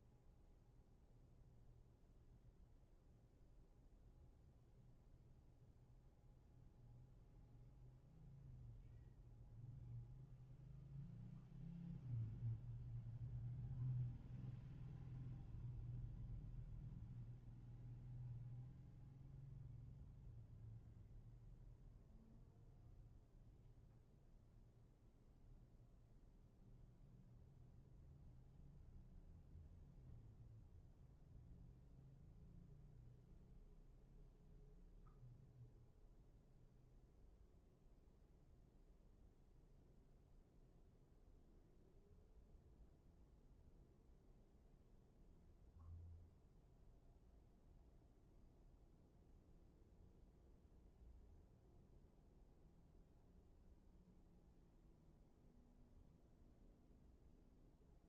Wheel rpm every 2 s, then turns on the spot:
0, 0, 0, 0, 0, 0, 0, 0, 0, 0, 0, 0, 0, 0, 0, 0, 0, 0, 0, 0, 0, 0, 0, 0, 0, 0, 0, 0, 0.
none